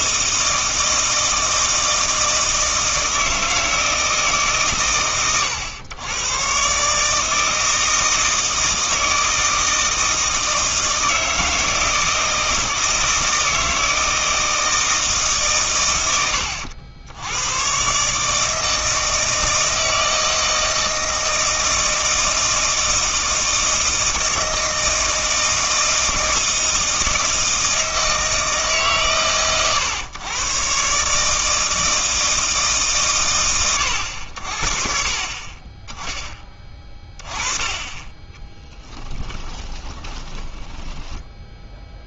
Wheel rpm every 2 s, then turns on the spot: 160, 160, 130, 140, 160, 160, 160, 160, 90, 160, 160, 160, 160, 160, 150, 130, 150, 50, 20, 10, 10.
38-42